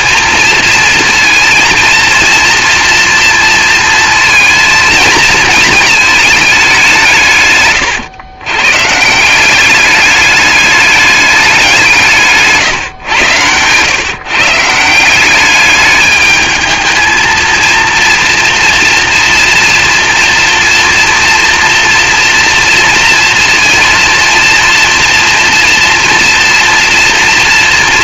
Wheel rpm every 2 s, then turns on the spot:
230, 240, 220, 170, 150, 210, 130, 170, 220, 230, 230, 230, 240, 240.
none